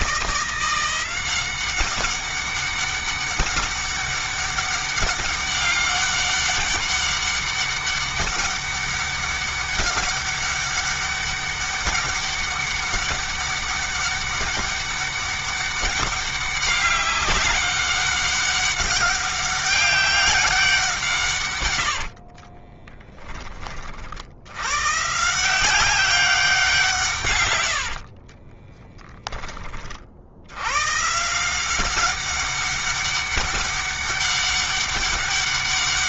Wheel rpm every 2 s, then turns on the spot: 180, 200, 200, 200, 200, 200, 200, 200, 200, 200, 180, 20, 120, 170, 20, 110, 200, 200.
22-24 28-30